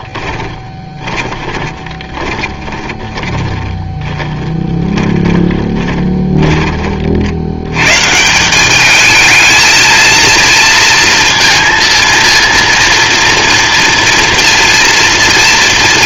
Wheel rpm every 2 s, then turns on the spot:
20, 20, 10, 30, 200, 230, 230, 230.
0-6